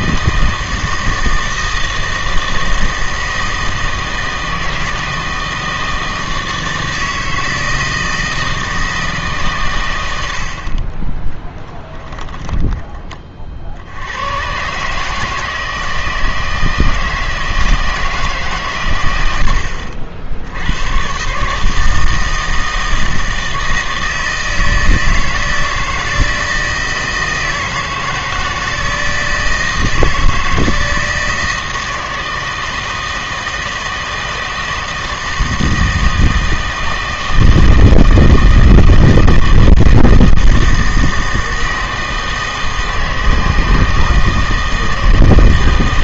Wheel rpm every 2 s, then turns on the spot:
160, 160, 160, 160, 160, 40, 10, 130, 160, 130, 90, 160, 160, 160, 160, 160, 160, 160, 160, 160, 160, 160, 160.
none